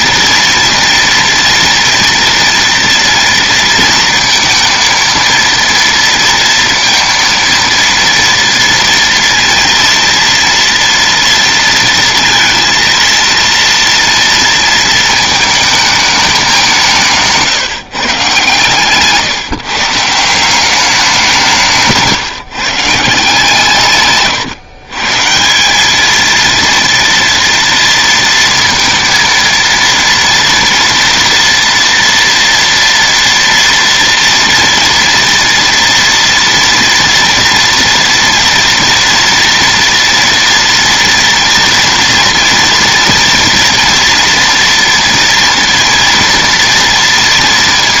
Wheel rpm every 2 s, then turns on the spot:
230, 230, 230, 230, 230, 230, 230, 230, 210, 140, 170, 160, 130, 220, 230, 230, 230, 240, 230, 230, 230, 230, 230, 230.
none